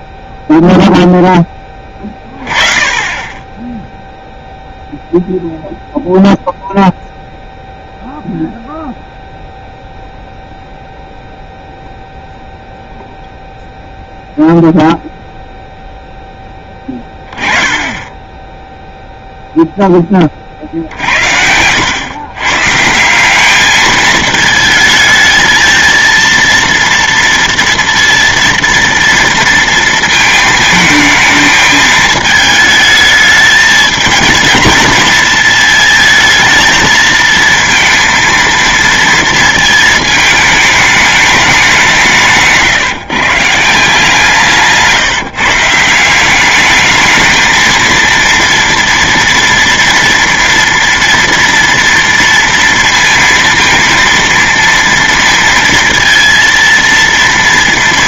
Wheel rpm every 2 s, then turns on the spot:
0, 20, 0, 0, 0, 0, 0, 0, 10, 10, 50, 130, 220, 230, 230, 220, 220, 230, 220, 230, 210, 150, 160, 200, 230, 230, 230, 230, 230.
44-46